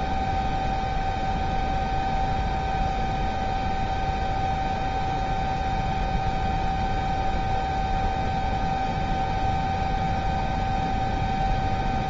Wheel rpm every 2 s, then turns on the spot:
0, 0, 0, 0, 0, 0.
none